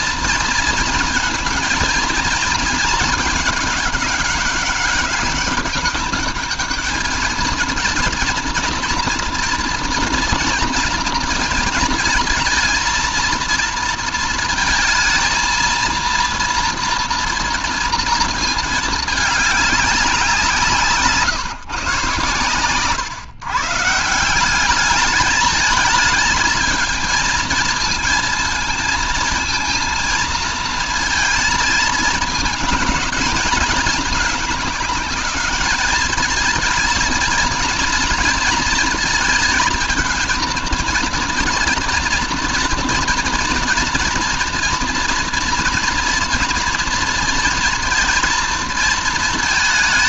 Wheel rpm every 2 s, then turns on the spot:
230, 220, 200, 210, 230, 230, 220, 230, 230, 220, 160, 110, 190, 220, 230, 220, 220, 210, 230, 230, 230, 230, 230, 230, 230.
none